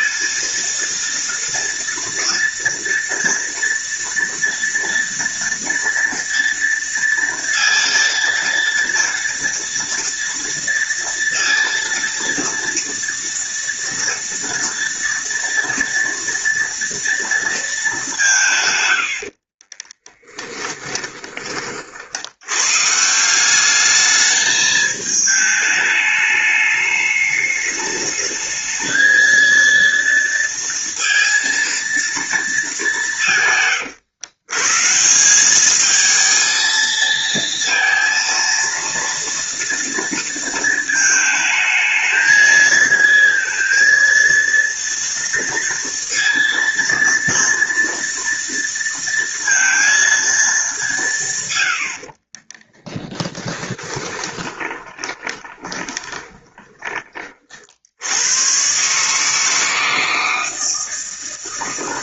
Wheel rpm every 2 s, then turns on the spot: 230, 230, 230, 230, 230, 230, 230, 230, 230, 100, 20, 150, 220, 210, 220, 230, 200, 150, 230, 230, 220, 220, 230, 230, 230, 190, 20, 20, 20, 140, 160.
20-22 52-56